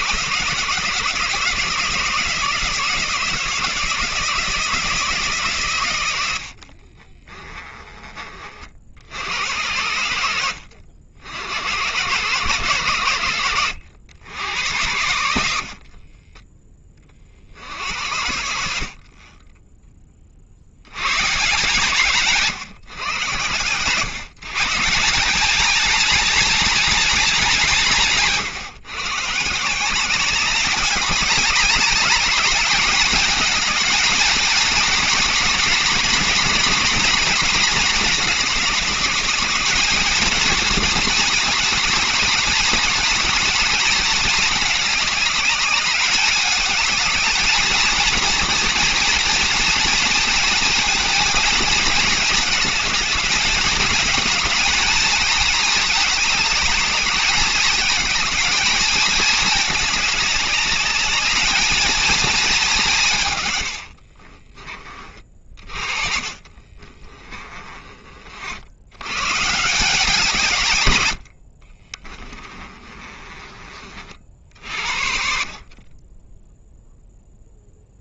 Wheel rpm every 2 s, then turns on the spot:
160, 170, 160, 60, 50, 80, 120, 80, 20, 70, 70, 130, 150, 230, 140, 190, 210, 220, 230, 210, 230, 230, 220, 210, 230, 230, 200, 220, 210, 220, 210, 210, 30, 40, 80, 140, 20, 60, 0.
6-8 64-68 72-74